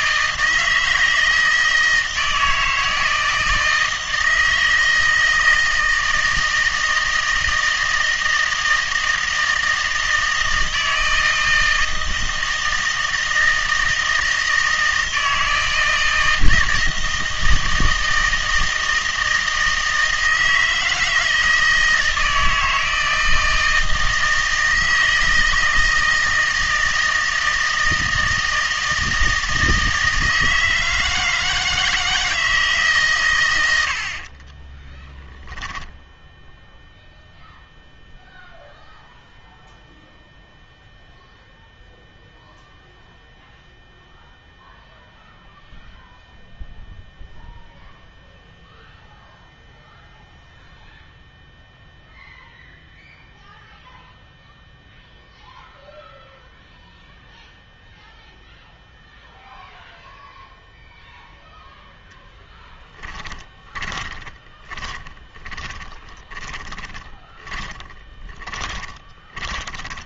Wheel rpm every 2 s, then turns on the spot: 160, 160, 160, 160, 160, 160, 160, 160, 160, 160, 160, 160, 160, 160, 160, 160, 150, 10, 0, 0, 0, 0, 0, 0, 0, 0, 0, 0, 0, 0, 0, 10, 20, 20, 20.
34-36 62-70